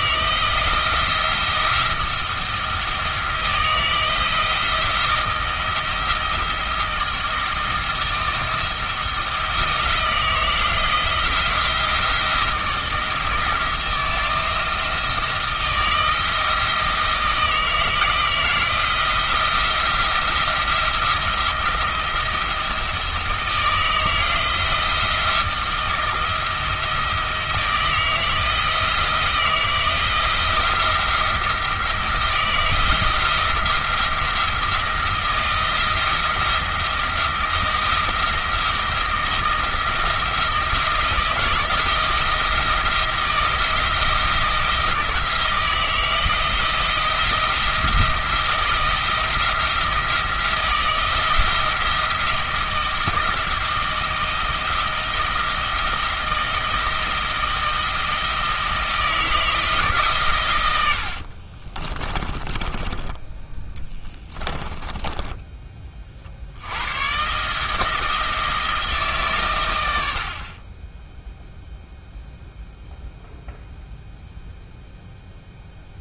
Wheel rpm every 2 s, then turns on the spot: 160, 160, 170, 170, 170, 170, 170, 160, 160, 170, 170, 170, 170, 170, 170, 170, 160, 170, 170, 170, 160, 170, 170, 170, 170, 170, 170, 160, 160, 170, 90, 20, 20, 100, 160, 20, 0, 0.
64-66